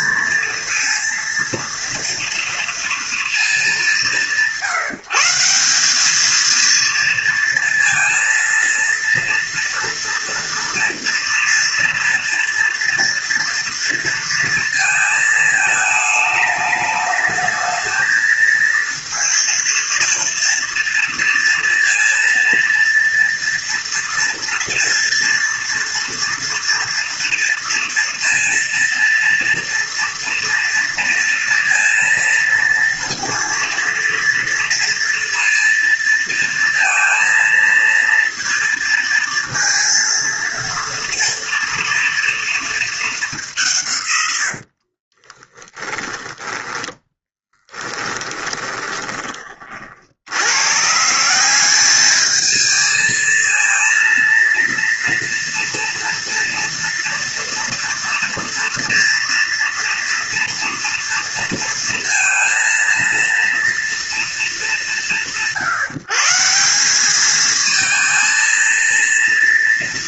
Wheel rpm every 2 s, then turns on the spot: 230, 230, 180, 230, 230, 230, 230, 220, 210, 230, 230, 230, 230, 230, 230, 230, 230, 230, 230, 230, 230, 220, 60, 10, 20, 150, 220, 230, 230, 230, 230, 230, 180, 190, 230.
44-50